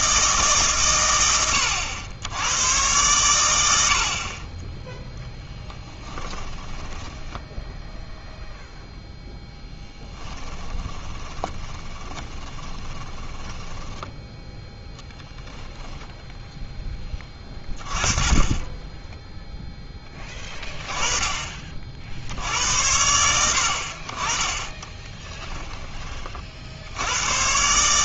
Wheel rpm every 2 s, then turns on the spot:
130, 110, 10, 10, 0, 10, 20, 0, 10, 10, 20, 80, 20, 70.
6-8 10-14 24-26